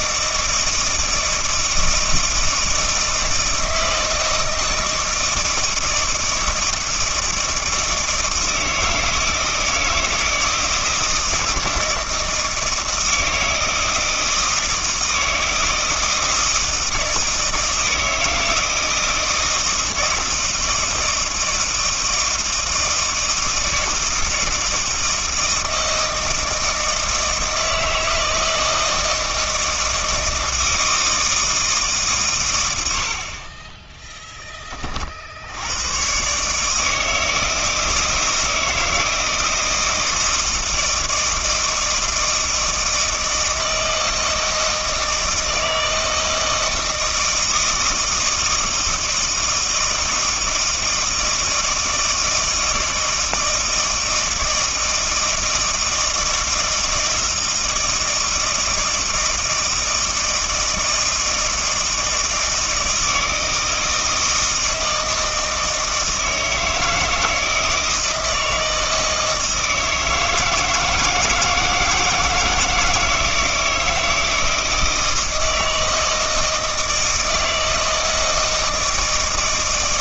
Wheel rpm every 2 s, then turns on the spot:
160, 160, 160, 160, 160, 160, 160, 160, 160, 160, 160, 160, 160, 160, 160, 160, 110, 30, 160, 160, 160, 160, 160, 160, 160, 160, 160, 160, 160, 160, 160, 160, 160, 160, 160, 160, 160, 160, 160, 160.
none